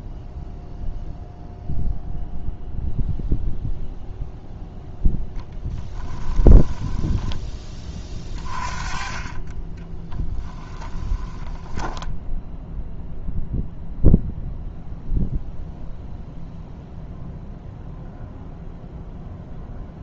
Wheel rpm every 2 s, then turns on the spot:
0, 0, 0, 10, 30, 10, 0, 0, 0, 0.
10-12